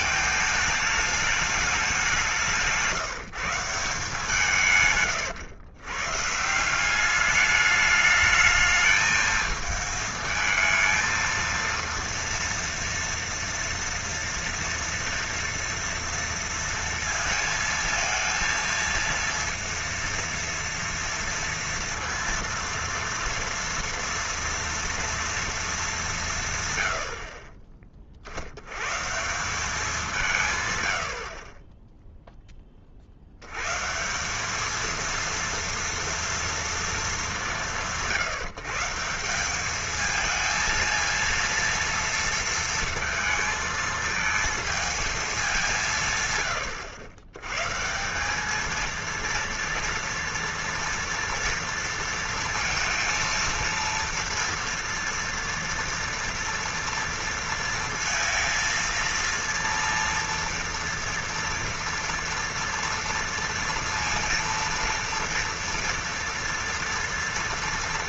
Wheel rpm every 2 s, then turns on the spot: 210, 170, 140, 180, 220, 220, 230, 230, 230, 230, 230, 230, 230, 120, 110, 120, 20, 210, 230, 160, 230, 230, 220, 100, 220, 230, 230, 230, 230, 230, 230, 230, 230, 230.
2-4